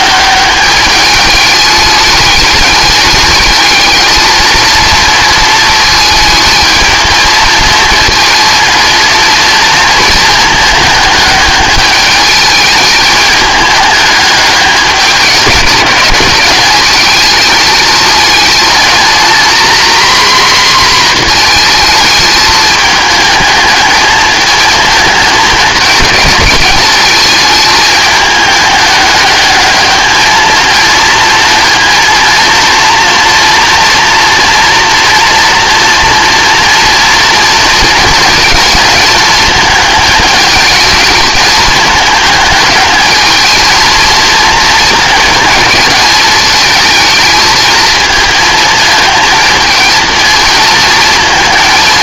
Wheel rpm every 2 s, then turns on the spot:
200, 210, 220, 220, 230, 220, 210, 200, 200, 220, 250, 220, 220, 210, 210, 220, 230, 230, 230, 230, 220, 210, 230, 220, 220, 220.
none